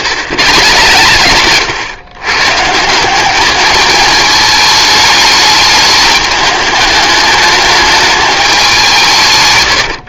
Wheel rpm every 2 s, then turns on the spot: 150, 160, 210, 210, 180.
none